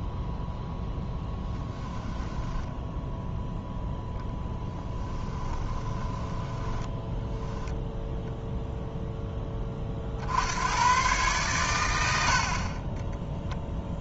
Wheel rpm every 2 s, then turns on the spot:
0, 0, 10, 10, 0, 110, 30.
4-8